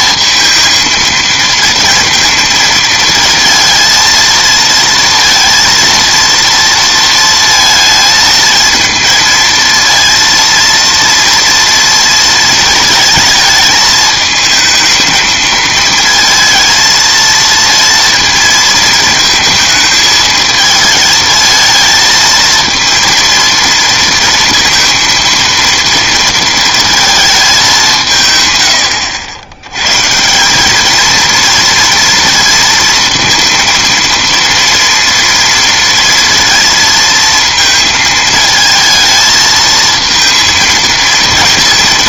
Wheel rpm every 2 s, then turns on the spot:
230, 230, 230, 230, 220, 230, 230, 220, 230, 220, 220, 230, 230, 230, 120, 190, 230, 230, 230, 220, 230.
none